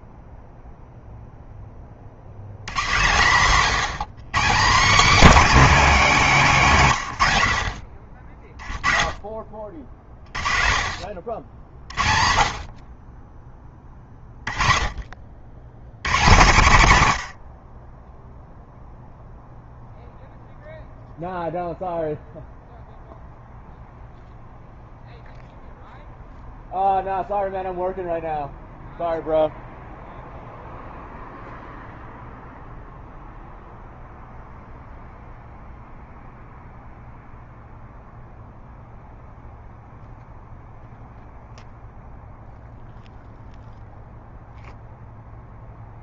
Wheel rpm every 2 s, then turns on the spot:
0, 80, 200, 240, 40, 40, 40, 30, 140, 0, 0, 0, 0, 0, 0, 0, 0, 0, 0, 0, 0, 0, 0.
none